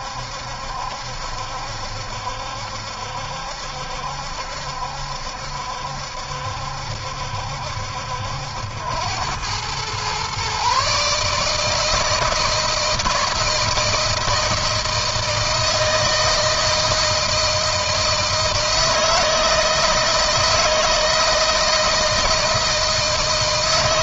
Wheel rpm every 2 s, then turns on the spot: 70, 70, 70, 70, 90, 140, 160, 160, 160, 160, 160, 160.
none